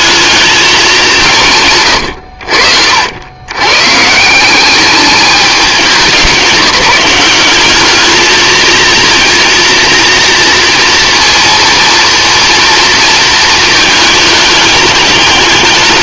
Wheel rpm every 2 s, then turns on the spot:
190, 70, 200, 200, 230, 230, 230, 210.
none